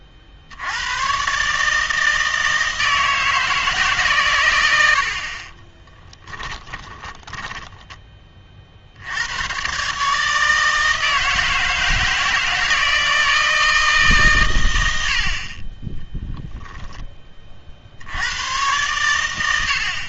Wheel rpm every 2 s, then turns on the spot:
100, 160, 80, 20, 70, 160, 160, 100, 10, 110.
6-8 16-18